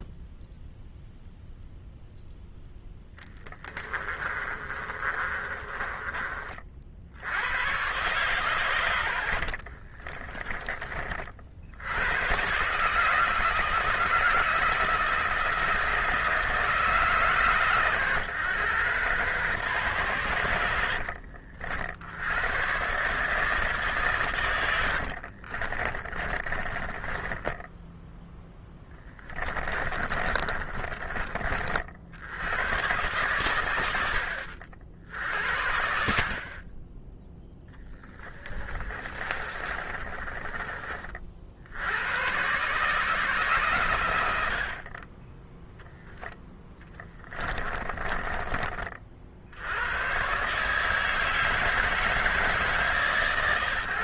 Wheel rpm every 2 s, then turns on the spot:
0, 10, 30, 60, 110, 30, 150, 160, 150, 120, 70, 130, 80, 20, 20, 30, 110, 60, 20, 30, 30, 140, 40, 10, 40, 150, 150.
4-6 24-32 38-40 46-48